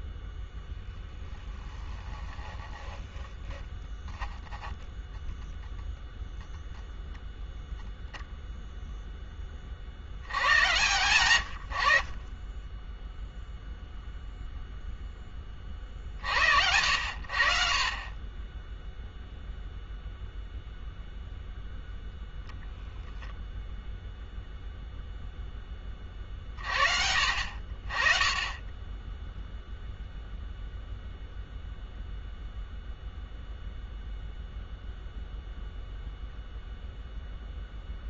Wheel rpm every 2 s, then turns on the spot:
0, 10, 10, 0, 0, 120, 10, 0, 80, 0, 0, 0, 0, 50, 20, 0, 0, 0, 0.
2-6